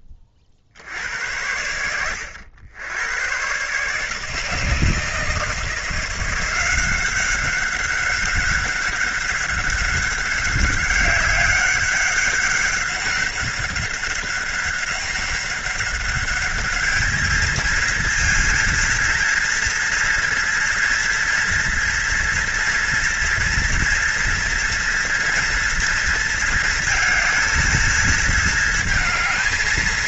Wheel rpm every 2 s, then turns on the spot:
60, 100, 160, 180, 200, 200, 200, 200, 210, 230, 230, 230, 230, 220, 230.
none